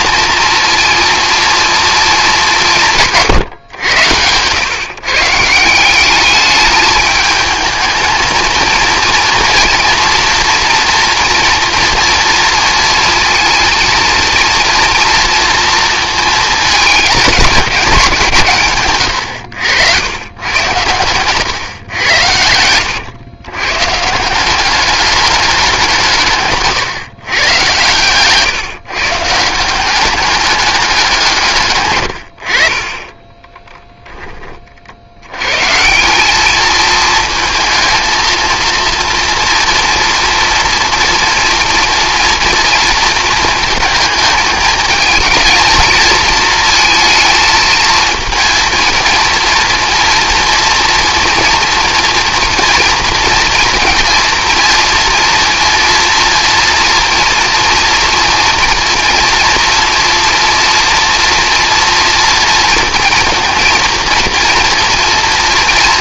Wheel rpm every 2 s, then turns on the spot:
230, 190, 120, 210, 230, 240, 230, 240, 220, 120, 110, 100, 190, 140, 140, 200, 50, 40, 210, 230, 230, 230, 220, 220, 220, 230, 240, 230, 240, 230, 230, 230, 230.
none